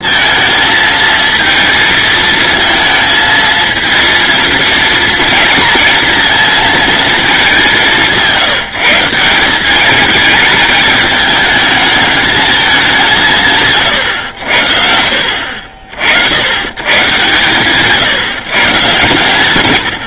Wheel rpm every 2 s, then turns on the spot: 220, 220, 230, 230, 170, 210, 200, 60, 120, 120.
none